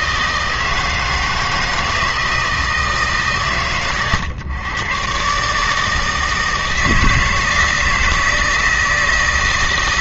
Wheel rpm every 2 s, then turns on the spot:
160, 150, 130, 160, 160.
none